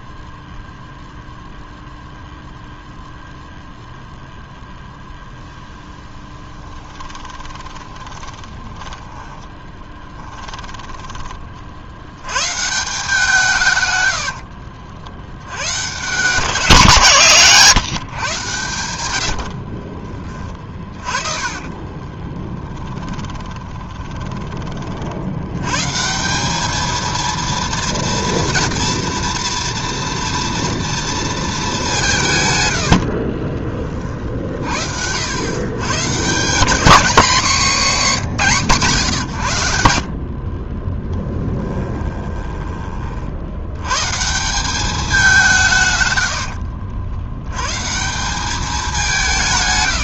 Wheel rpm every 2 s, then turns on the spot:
0, 0, 0, 10, 20, 20, 150, 70, 150, 110, 20, 20, 30, 210, 230, 230, 100, 60, 190, 170, 30, 20, 190, 70, 200.
6-12 14-16 20-24 32-34 46-48